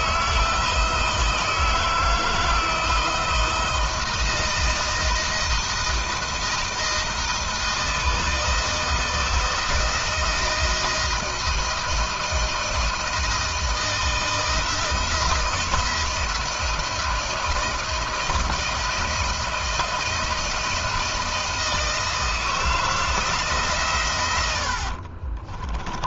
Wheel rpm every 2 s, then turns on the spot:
160, 160, 160, 160, 160, 170, 160, 170, 160, 160, 170, 160, 60.
24-26